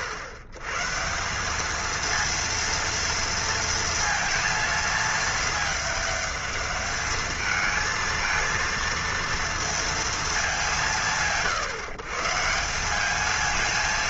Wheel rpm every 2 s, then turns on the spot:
110, 230, 220, 210, 230, 190, 200.
none